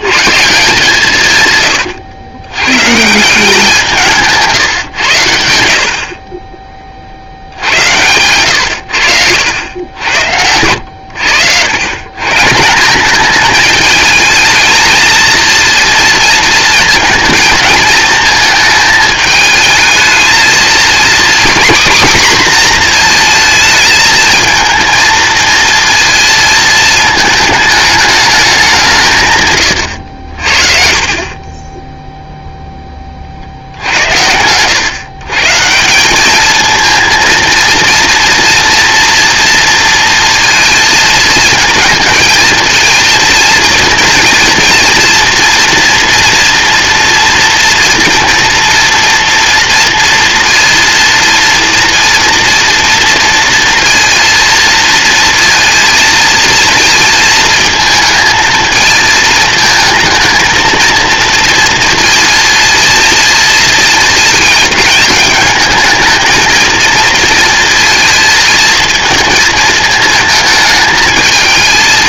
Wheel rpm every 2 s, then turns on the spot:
150, 110, 150, 30, 110, 80, 170, 220, 220, 220, 230, 250, 230, 220, 210, 60, 0, 110, 220, 230, 230, 220, 230, 230, 230, 230, 230, 230, 220, 220, 230, 230, 220, 220, 230, 220.
none